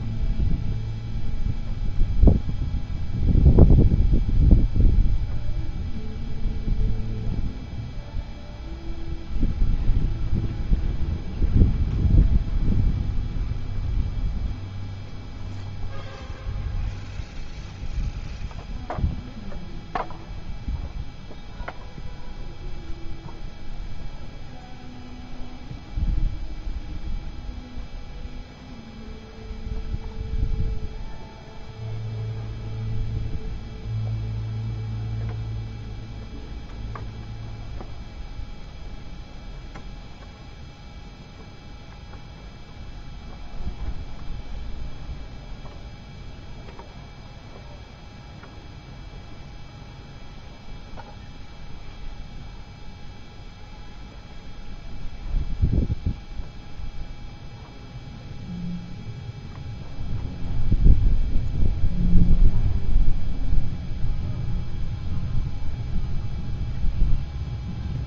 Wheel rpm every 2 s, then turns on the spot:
0, 0, 0, 0, 0, 0, 0, 0, 0, 0, 0, 0, 0, 0, 0, 0, 0, 0, 0, 0, 0, 0, 0, 0, 0, 0, 0, 0, 0, 0, 0, 0, 0, 0.
none